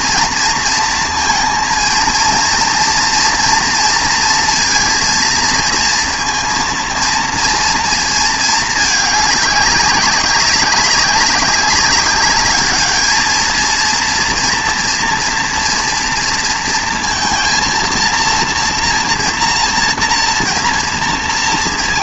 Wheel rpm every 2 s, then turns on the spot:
230, 230, 230, 230, 220, 200, 210, 230, 230, 230, 230.
none